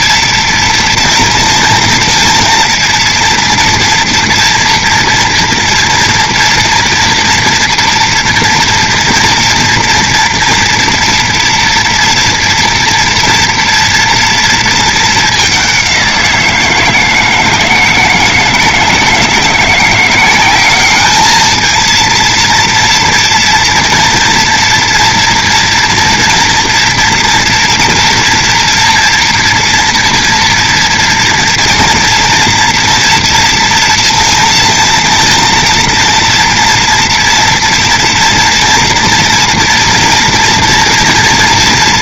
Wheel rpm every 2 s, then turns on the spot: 230, 230, 230, 230, 230, 230, 230, 230, 160, 160, 200, 230, 230, 230, 240, 230, 230, 230, 230, 230, 240.
none